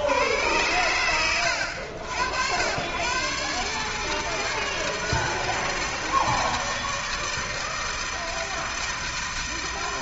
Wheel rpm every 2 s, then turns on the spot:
60, 90, 160, 160, 160.
none